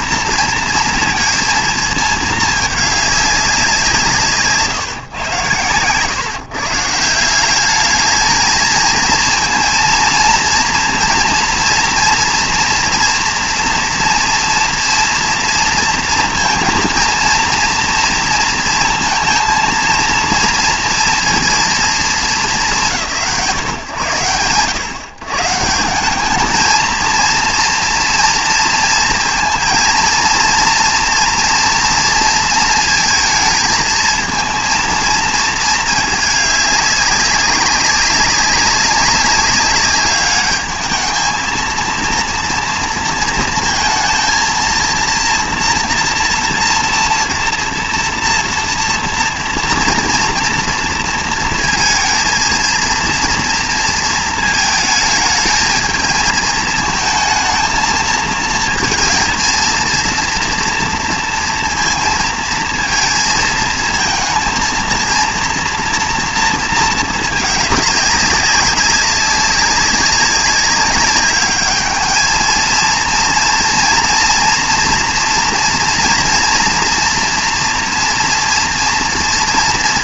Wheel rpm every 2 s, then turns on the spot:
230, 210, 140, 150, 220, 230, 230, 230, 230, 230, 230, 170, 90, 220, 230, 230, 220, 230, 210, 200, 210, 230, 230, 230, 230, 230, 230, 220, 220, 230, 240, 230, 230, 230, 200, 200, 230, 240, 230, 230.
none